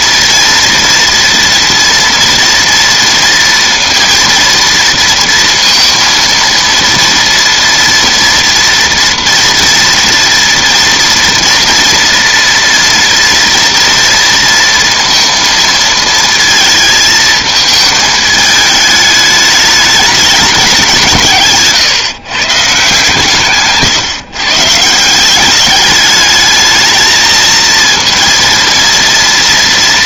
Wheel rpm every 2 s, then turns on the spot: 240, 230, 230, 230, 230, 230, 230, 230, 220, 210, 190, 140, 150, 220, 230.
none